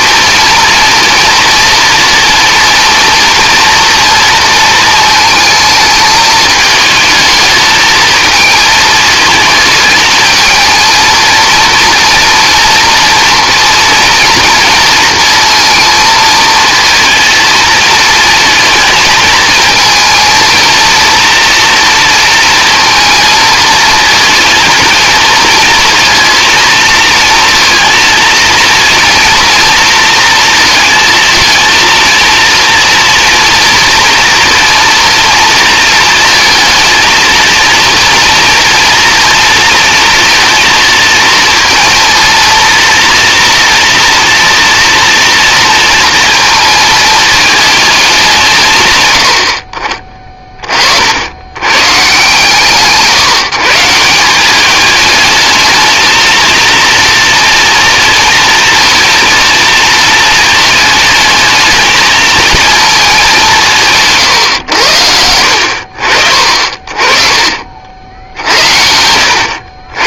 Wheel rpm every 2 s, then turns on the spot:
230, 230, 230, 220, 220, 220, 230, 230, 230, 220, 230, 230, 230, 230, 230, 230, 230, 230, 220, 240, 230, 230, 230, 230, 140, 50, 150, 210, 230, 230, 220, 220, 90, 30, 70.
none